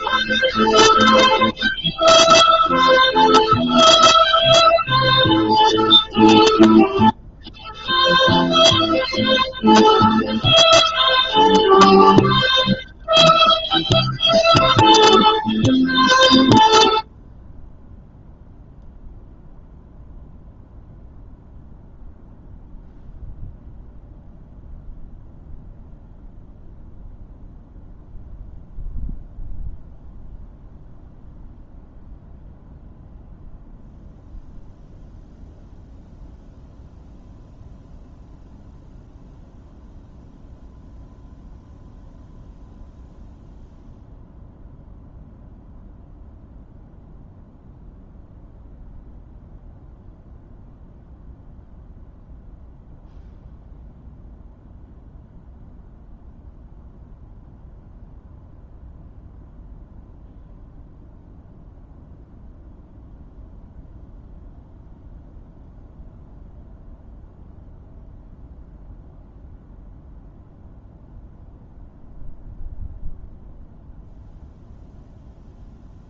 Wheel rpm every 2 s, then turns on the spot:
0, 0, 0, 0, 0, 0, 0, 0, 0, 0, 0, 0, 0, 0, 0, 0, 0, 0, 0, 0, 0, 0, 0, 0, 0, 0, 0, 0, 0, 0, 0, 0, 0, 0, 0, 0, 0, 0.
none